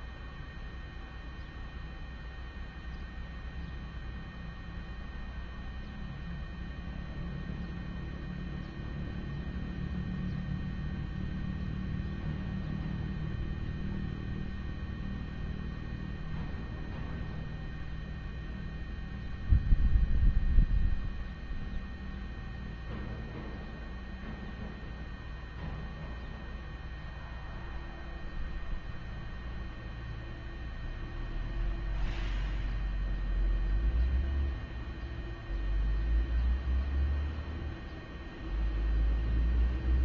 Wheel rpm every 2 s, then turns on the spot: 0, 0, 0, 0, 0, 0, 0, 0, 0, 0, 0, 0, 0, 0, 0, 0, 0, 0, 0, 0.
none